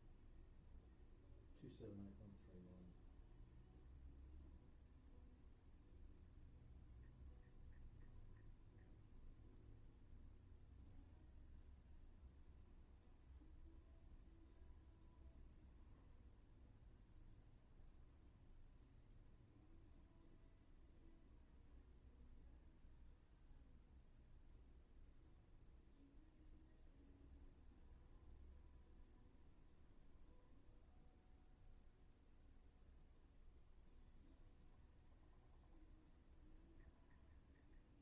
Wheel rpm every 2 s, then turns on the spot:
0, 0, 0, 0, 0, 0, 0, 0, 0, 0, 0, 0, 0, 0, 0, 0, 0, 0, 0.
none